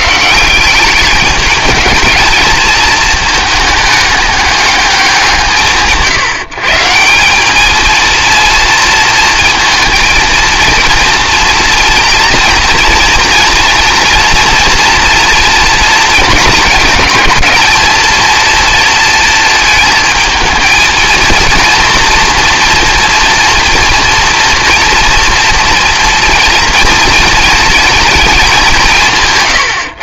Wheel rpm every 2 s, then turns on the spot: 200, 220, 200, 160, 230, 230, 230, 230, 220, 230, 230, 230, 230, 230, 180.
none